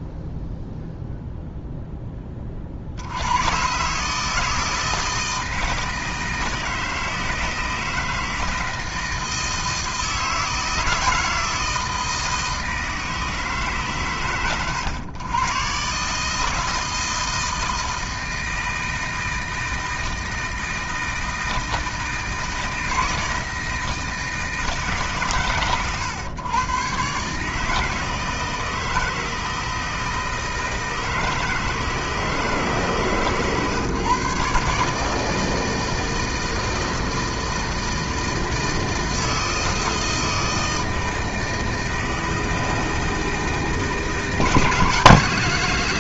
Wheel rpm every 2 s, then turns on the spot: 0, 40, 160, 160, 160, 160, 160, 100, 160, 160, 160, 160, 160, 120, 160, 160, 150, 150, 160, 160, 160, 160, 160.
none